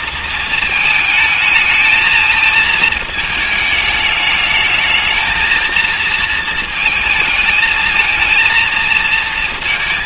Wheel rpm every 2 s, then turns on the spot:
220, 220, 210, 220, 230.
none